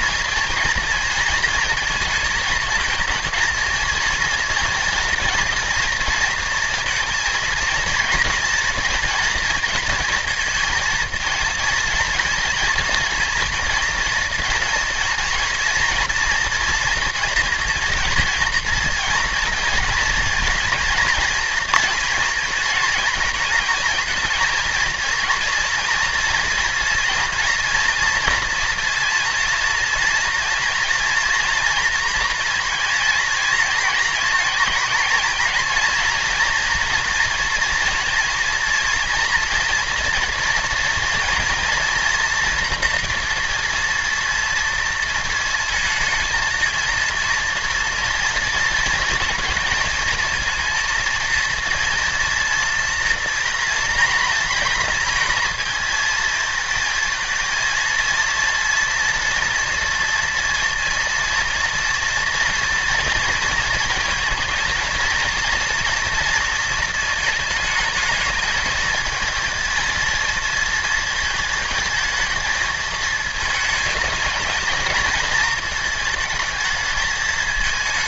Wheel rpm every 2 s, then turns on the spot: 230, 220, 240, 230, 230, 220, 230, 230, 230, 230, 230, 230, 230, 230, 230, 230, 230, 220, 230, 230, 230, 240, 230, 230, 230, 230, 230, 230, 220, 230, 240, 230, 230, 230, 220, 220, 220, 220, 220.
none